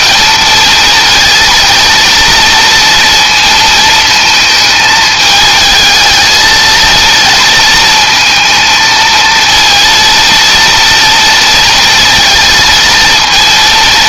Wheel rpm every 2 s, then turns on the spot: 230, 230, 220, 230, 220, 230, 230.
none